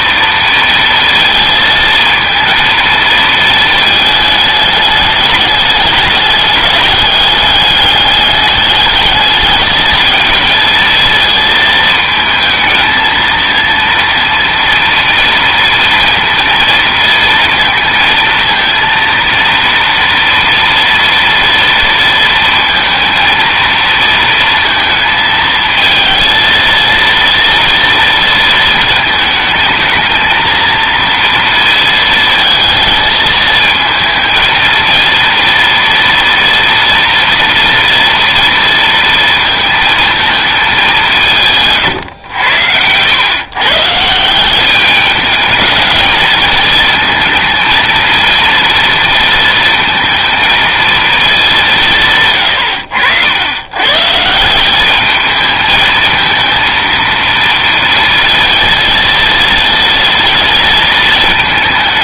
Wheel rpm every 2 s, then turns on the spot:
230, 230, 210, 210, 210, 220, 220, 230, 230, 230, 230, 230, 230, 230, 220, 230, 230, 230, 230, 230, 190, 100, 200, 230, 230, 230, 80, 200, 230, 230, 230.
none